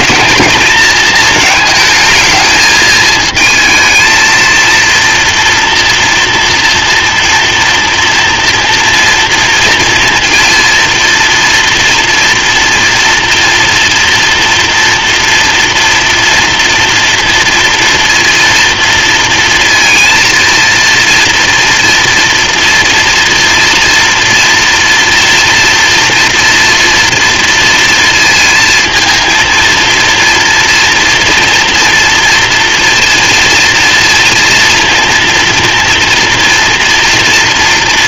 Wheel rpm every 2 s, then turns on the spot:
230, 220, 230, 230, 230, 230, 230, 240, 230, 230, 230, 230, 230, 230, 230, 230, 230, 230, 230.
none